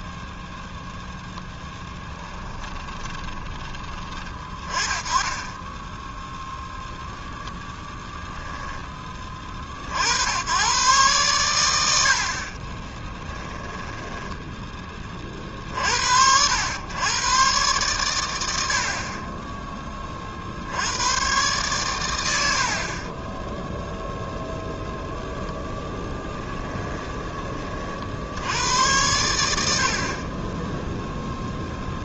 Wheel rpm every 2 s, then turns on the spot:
0, 20, 20, 0, 10, 120, 30, 20, 100, 60, 80, 50, 0, 10, 90, 10.
2-4 26-28